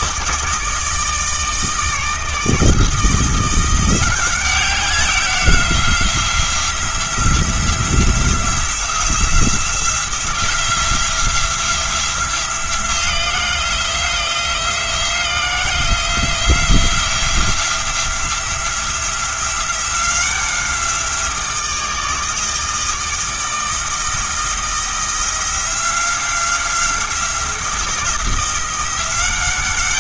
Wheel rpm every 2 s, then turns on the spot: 160, 160, 190, 180, 180, 170, 170, 170, 170, 170, 180, 160, 170, 180, 170.
none